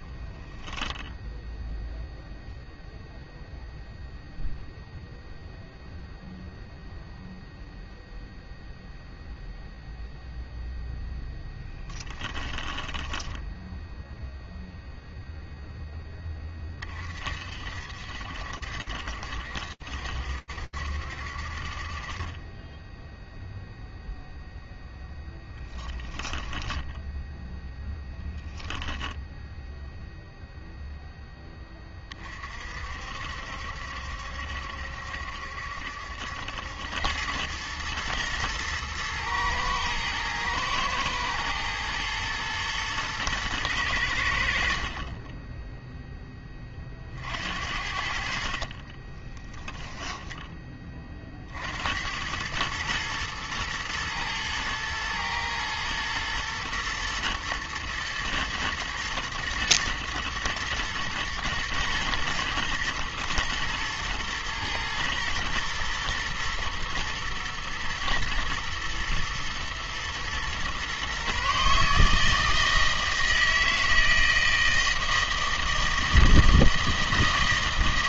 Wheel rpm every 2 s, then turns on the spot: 0, 0, 0, 0, 0, 20, 0, 30, 60, 70, 10, 0, 10, 0, 0, 30, 70, 70, 110, 110, 110, 100, 10, 60, 10, 80, 110, 120, 110, 120, 110, 110, 110, 110, 110, 150, 160, 160, 160.
10-12 24-26 48-50